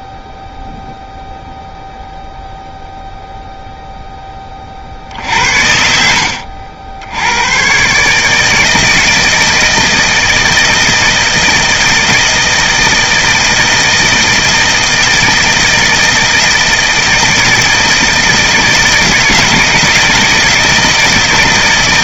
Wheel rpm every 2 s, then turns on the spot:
0, 0, 50, 80, 160, 160, 160, 160, 160, 160, 160.
none